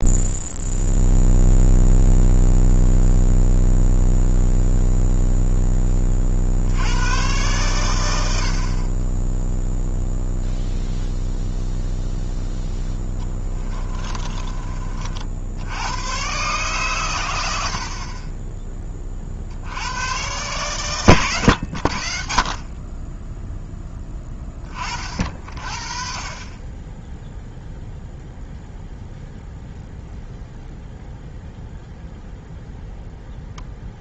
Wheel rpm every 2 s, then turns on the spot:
0, 0, 0, 80, 50, 0, 0, 30, 130, 20, 130, 40, 20, 30, 0, 0, 0.
none